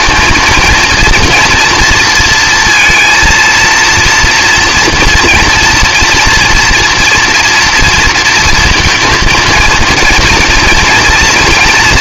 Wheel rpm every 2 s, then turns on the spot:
230, 230, 230, 240, 230, 230.
none